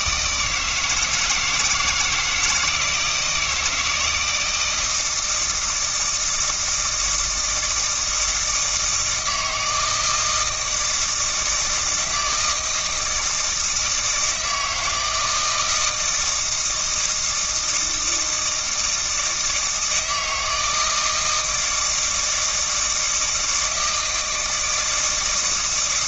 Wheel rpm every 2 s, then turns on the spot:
160, 160, 160, 160, 160, 170, 160, 160, 160, 160, 160, 160, 160.
none